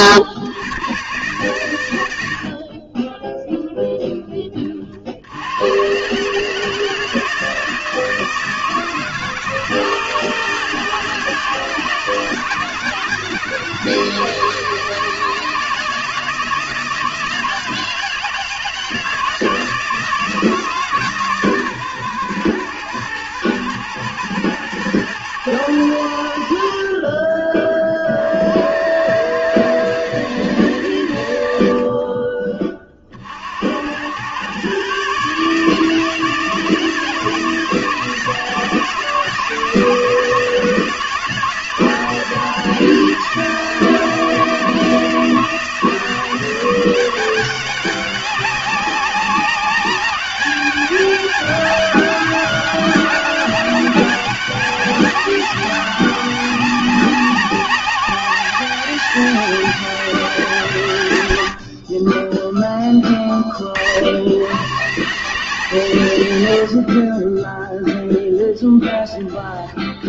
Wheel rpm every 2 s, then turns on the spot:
120, 30, 40, 150, 160, 160, 160, 160, 160, 160, 150, 120, 120, 50, 90, 100, 30, 130, 160, 160, 160, 160, 160, 180, 190, 200, 200, 200, 190, 200, 140, 20, 150, 70, 20.
none